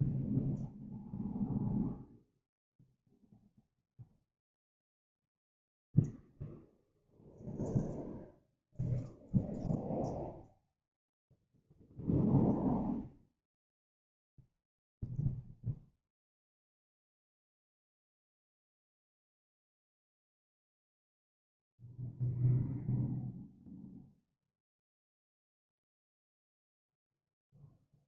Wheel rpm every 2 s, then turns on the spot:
0, 0, 0, 0, 0, 0, 0, 0, 0, 0, 0, 0, 0, 0.
none